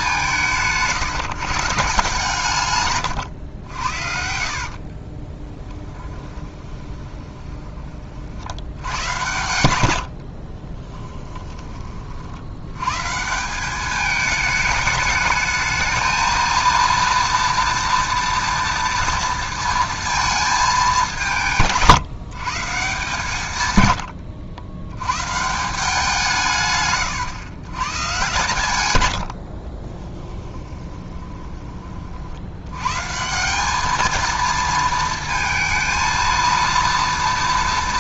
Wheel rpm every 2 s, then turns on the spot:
160, 140, 60, 20, 70, 30, 100, 210, 230, 230, 220, 150, 80, 150, 120, 10, 100, 220, 230.
4-8 10-12 30-32